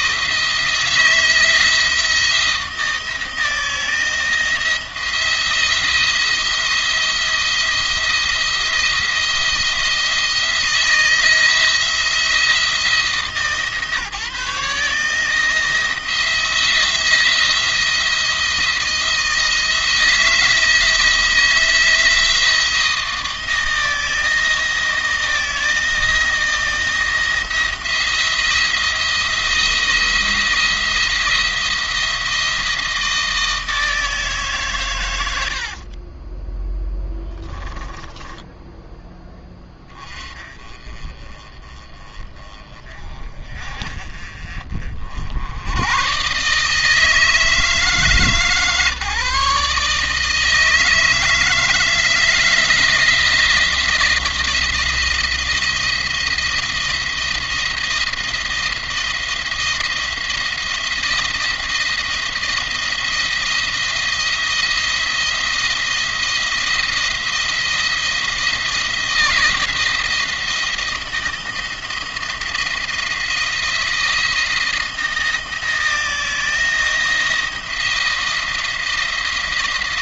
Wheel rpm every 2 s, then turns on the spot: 160, 160, 160, 170, 170, 160, 170, 150, 170, 170, 160, 160, 170, 170, 170, 170, 170, 130, 10, 10, 30, 30, 40, 150, 150, 160, 170, 170, 170, 170, 170, 170, 170, 170, 170, 170, 160, 160, 170, 170.
36-38